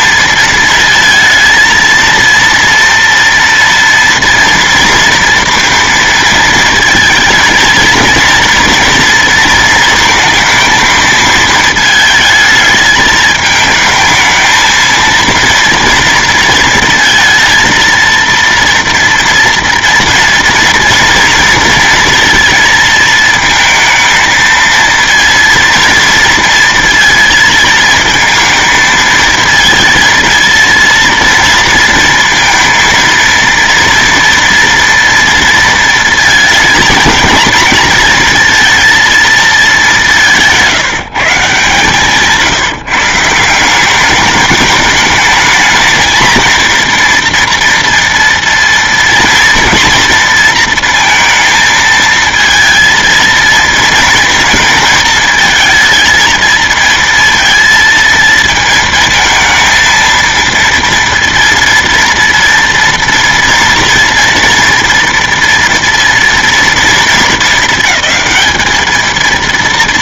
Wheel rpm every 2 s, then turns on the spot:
230, 230, 230, 220, 230, 220, 220, 230, 230, 230, 230, 230, 230, 230, 220, 230, 230, 230, 220, 230, 160, 160, 210, 230, 230, 230, 230, 230, 230, 220, 230, 230, 230, 230, 220.
none